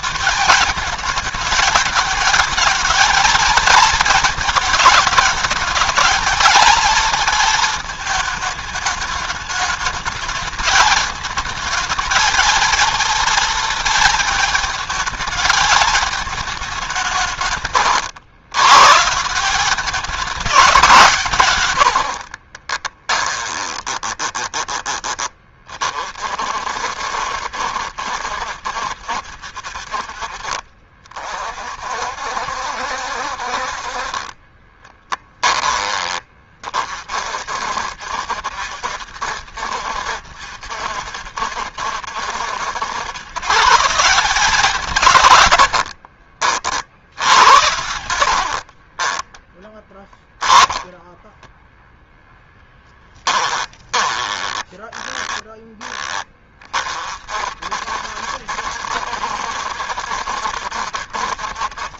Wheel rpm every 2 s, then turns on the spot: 220, 230, 220, 230, 210, 220, 230, 220, 180, 150, 170, 20, 20, 60, 60, 40, 60, 20, 40, 70, 70, 110, 150, 60, 40, 10, 10, 10, 40, 70, 60.
22-24 34-36 48-56